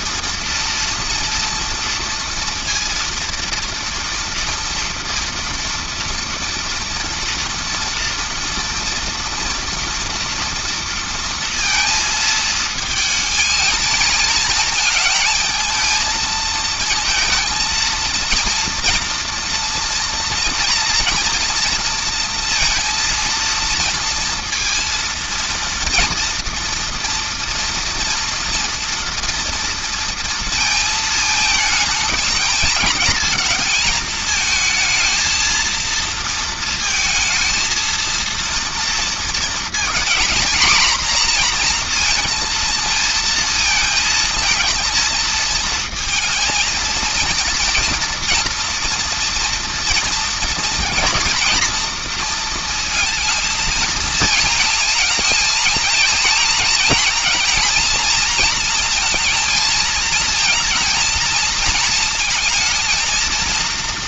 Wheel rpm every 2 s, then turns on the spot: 230, 230, 230, 230, 230, 230, 220, 220, 220, 230, 230, 230, 230, 230, 230, 220, 220, 220, 220, 230, 240, 230, 230, 230, 230, 230, 230, 230, 230, 230, 230, 230.
none